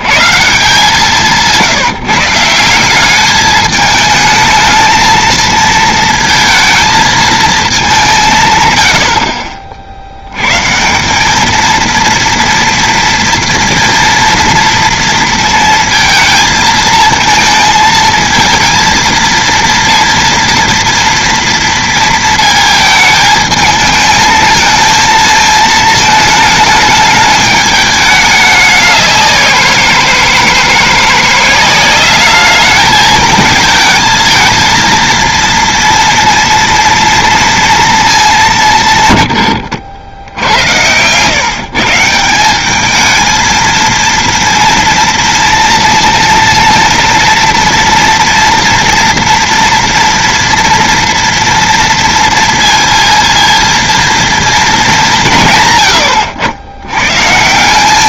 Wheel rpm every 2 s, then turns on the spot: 130, 160, 220, 230, 160, 110, 230, 230, 230, 220, 230, 230, 220, 210, 200, 160, 210, 230, 230, 190, 80, 180, 230, 230, 230, 230, 230, 230, 90.
40-42